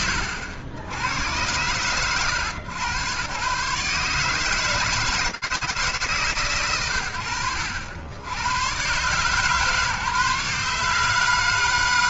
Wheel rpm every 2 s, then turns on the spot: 60, 120, 160, 80, 140, 140.
none